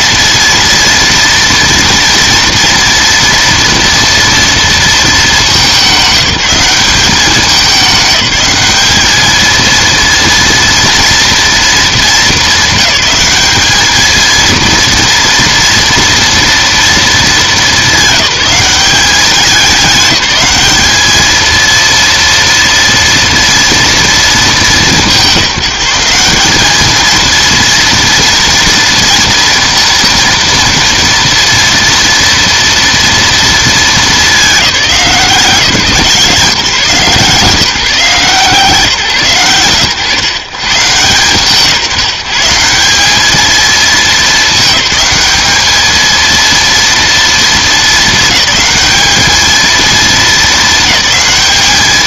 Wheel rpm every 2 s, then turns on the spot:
230, 230, 230, 200, 210, 230, 200, 230, 230, 190, 210, 230, 200, 210, 230, 230, 240, 200, 150, 150, 140, 170, 210, 230, 210, 220.
none